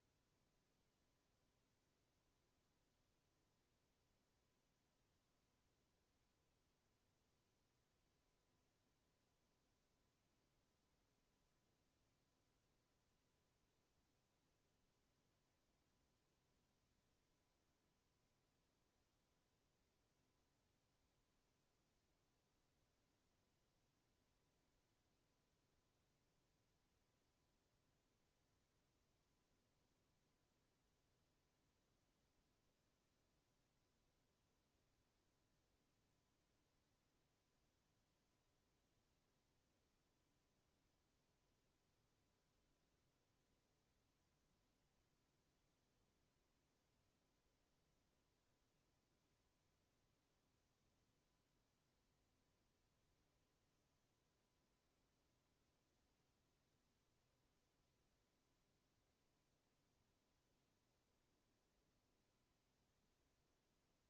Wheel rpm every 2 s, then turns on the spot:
0, 0, 0, 0, 0, 0, 0, 0, 0, 0, 0, 0, 0, 0, 0, 0, 0, 0, 0, 0, 0, 0, 0, 0, 0, 0, 0, 0, 0, 0, 0, 0.
none